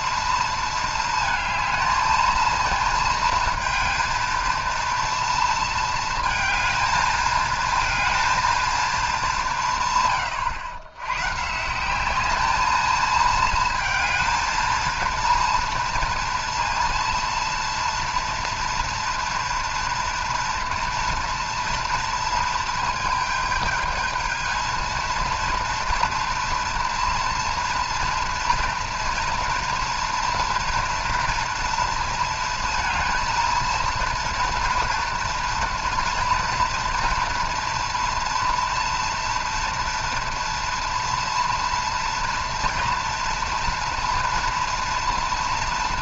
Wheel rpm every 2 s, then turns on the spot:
230, 220, 230, 220, 220, 100, 220, 230, 230, 230, 230, 220, 230, 240, 230, 230, 230, 240, 230, 230, 230, 230, 230.
none